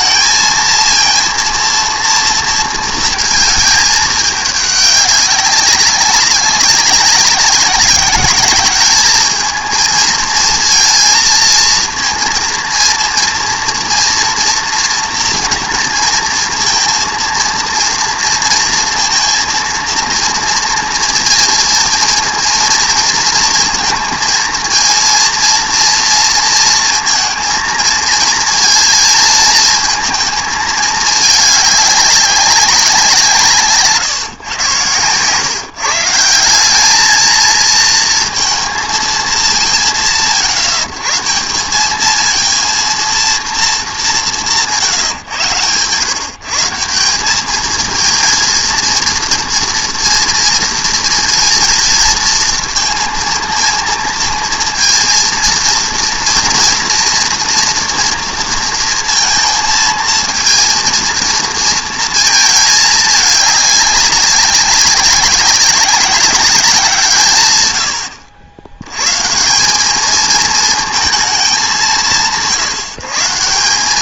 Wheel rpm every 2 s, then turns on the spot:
230, 230, 210, 200, 210, 230, 230, 230, 230, 230, 230, 230, 230, 220, 220, 220, 190, 130, 200, 230, 140, 230, 170, 180, 230, 230, 230, 230, 230, 230, 230, 220, 200, 170, 110, 230, 160.
none